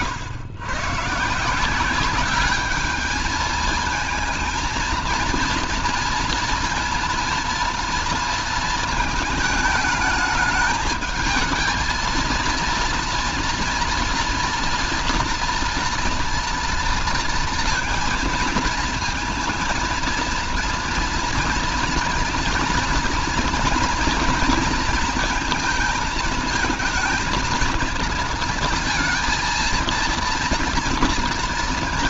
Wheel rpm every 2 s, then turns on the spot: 110, 200, 230, 230, 230, 210, 230, 230, 230, 220, 230, 230, 230, 220, 230, 230.
none